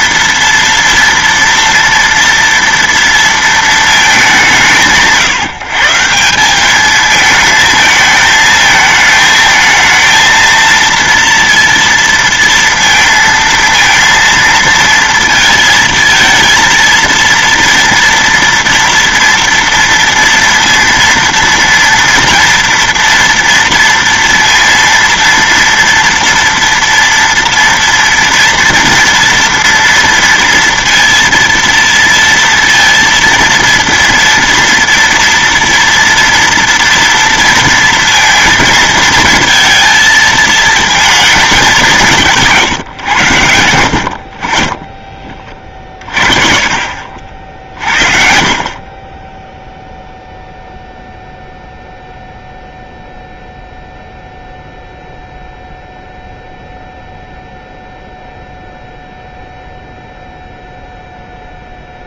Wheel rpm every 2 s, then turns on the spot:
230, 230, 160, 200, 220, 230, 230, 230, 230, 230, 230, 240, 230, 230, 230, 230, 230, 230, 230, 220, 230, 140, 30, 50, 40, 0, 0, 0, 0, 0, 0.
42-44